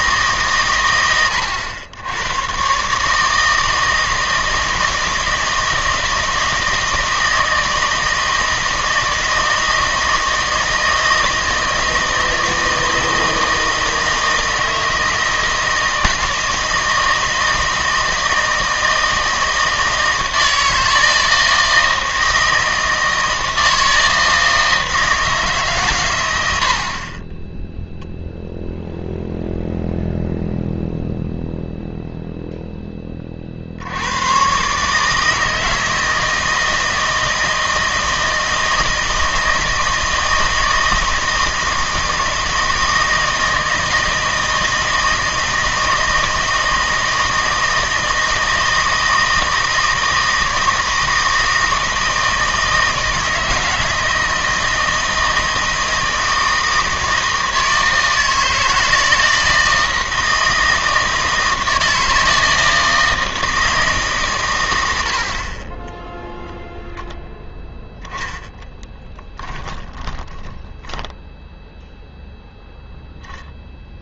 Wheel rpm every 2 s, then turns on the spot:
130, 130, 160, 160, 160, 160, 160, 160, 160, 160, 160, 160, 160, 70, 0, 0, 0, 130, 160, 160, 160, 160, 160, 160, 160, 160, 160, 160, 160, 160, 160, 160, 100, 0, 10, 20, 0.
68-72